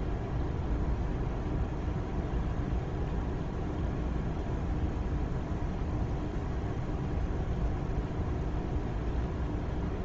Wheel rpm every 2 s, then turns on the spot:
0, 0, 0, 0, 0.
none